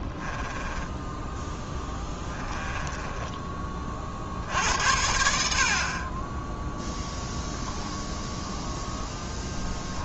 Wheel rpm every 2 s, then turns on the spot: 10, 10, 80, 0, 0.
0-4